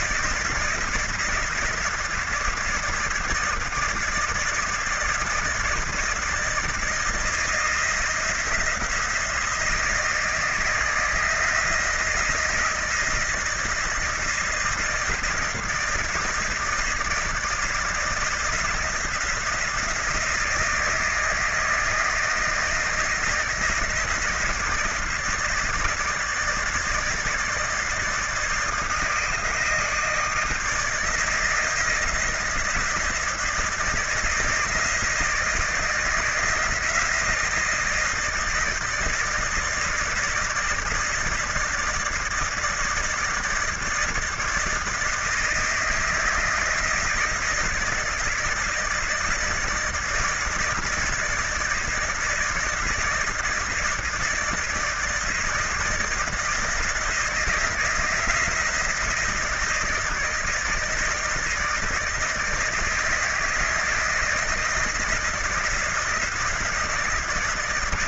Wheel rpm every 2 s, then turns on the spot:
160, 160, 160, 160, 170, 170, 160, 160, 170, 170, 160, 160, 160, 160, 160, 170, 170, 170, 160, 160, 160, 160, 160, 160, 160, 160, 170, 160, 170, 160, 160, 160, 160, 170.
none